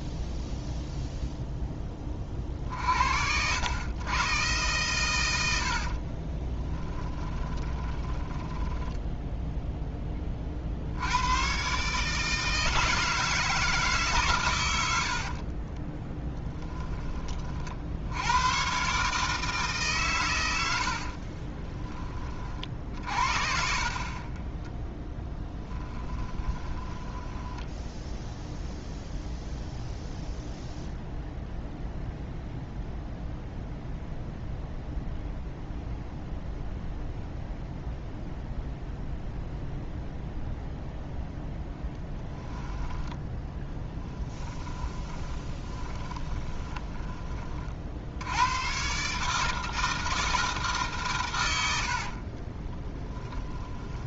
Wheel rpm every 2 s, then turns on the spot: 0, 50, 120, 10, 10, 60, 160, 100, 10, 130, 80, 50, 10, 20, 0, 0, 0, 0, 0, 0, 0, 10, 20, 20, 120, 150, 10.
6-10 16-18 24-28 42-48 52-54